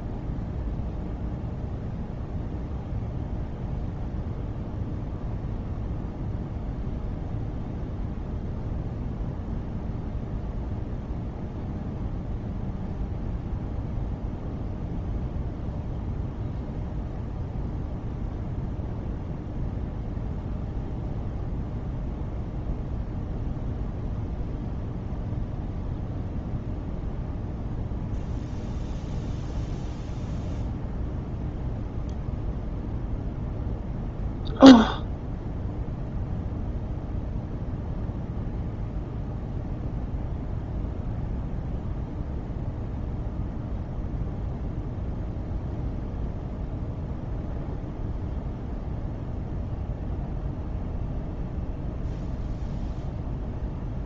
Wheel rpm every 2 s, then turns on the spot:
0, 0, 0, 0, 0, 0, 0, 0, 0, 0, 0, 0, 0, 0, 0, 0, 0, 0, 0, 0, 0, 0, 0, 0, 0, 0, 0.
none